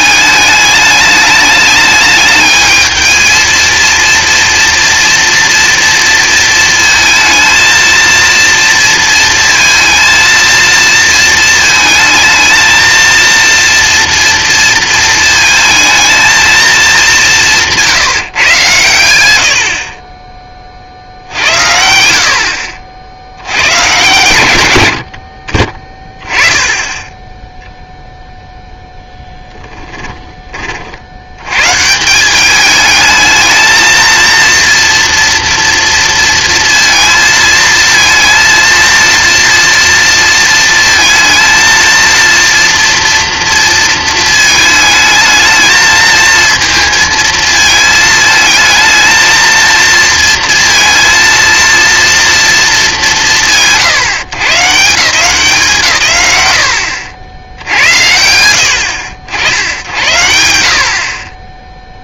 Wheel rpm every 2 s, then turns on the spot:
210, 220, 240, 230, 230, 230, 230, 230, 210, 120, 50, 60, 80, 10, 0, 40, 210, 230, 230, 230, 230, 240, 220, 230, 220, 230, 200, 160, 90, 90, 80.
none